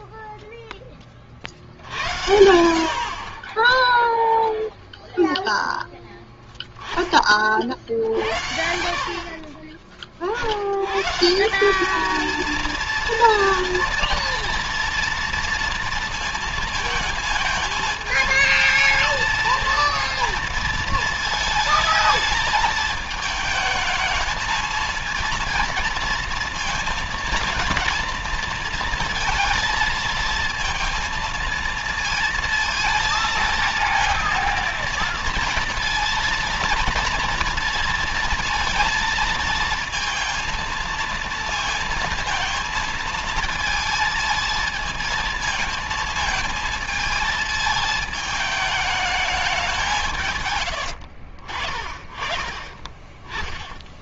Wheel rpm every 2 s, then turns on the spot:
0, 80, 10, 10, 60, 60, 220, 230, 230, 220, 220, 220, 230, 230, 230, 230, 230, 230, 230, 230, 230, 230, 220, 220, 210, 130, 40.
6-8 50-54